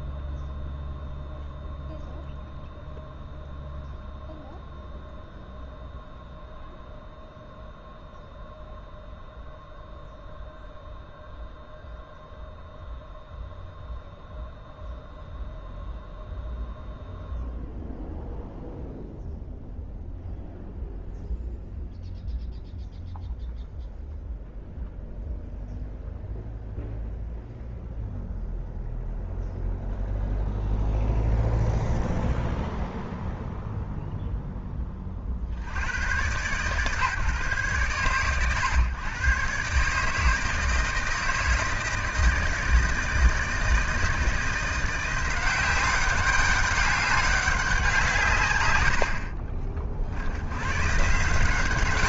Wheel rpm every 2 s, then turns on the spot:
0, 0, 0, 0, 0, 0, 0, 0, 0, 0, 0, 0, 0, 0, 0, 0, 0, 20, 140, 90, 150, 160, 170, 200, 150, 110.
none